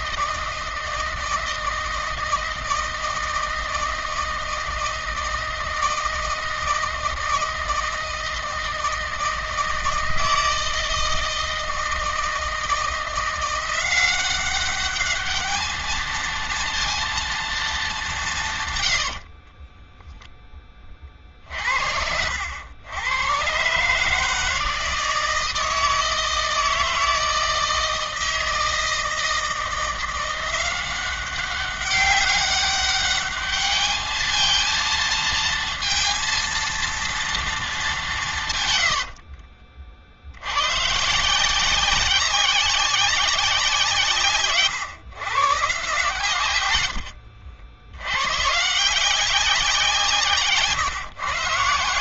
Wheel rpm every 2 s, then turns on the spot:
160, 160, 160, 160, 160, 160, 160, 200, 230, 100, 20, 90, 160, 160, 160, 180, 200, 220, 230, 100, 110, 190, 130, 110, 150, 150.
18-20 38-40 50-52